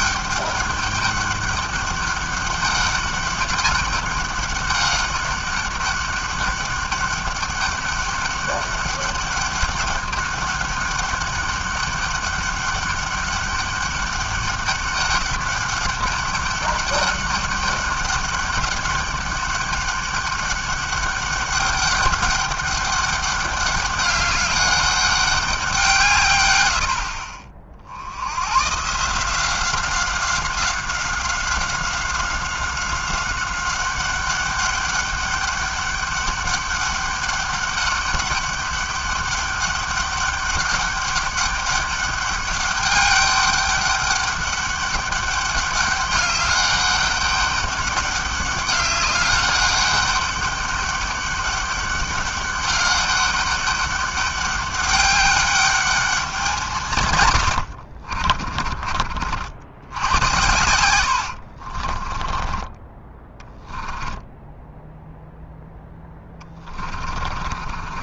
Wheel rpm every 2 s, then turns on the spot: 200, 200, 200, 200, 200, 200, 200, 200, 200, 200, 200, 200, 200, 90, 130, 190, 190, 200, 200, 200, 200, 200, 200, 200, 200, 200, 200, 200, 170, 30, 100, 20, 0, 30.
58-64 66-68